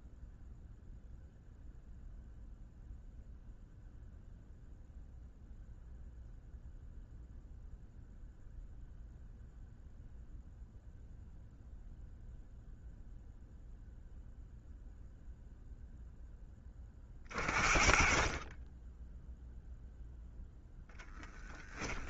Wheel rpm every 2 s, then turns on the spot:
0, 0, 0, 0, 0, 0, 0, 0, 20, 10, 10.
none